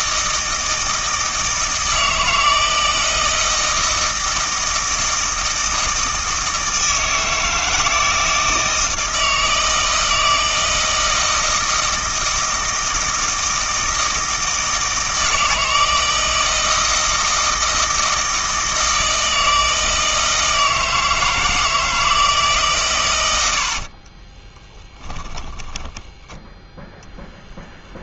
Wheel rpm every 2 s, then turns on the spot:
160, 160, 160, 160, 160, 160, 160, 160, 160, 160, 160, 150, 20, 0.
24-26